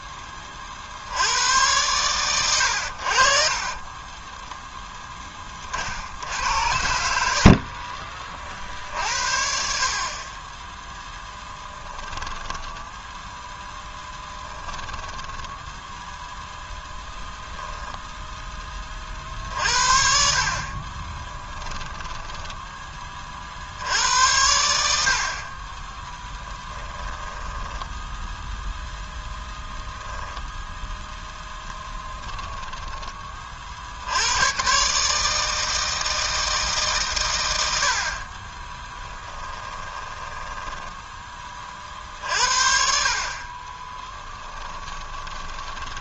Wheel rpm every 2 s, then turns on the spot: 50, 90, 10, 80, 50, 10, 10, 10, 10, 20, 50, 10, 70, 10, 0, 0, 10, 120, 150, 20, 10, 60, 20.
12-18 20-22 26-28 38-42 44-46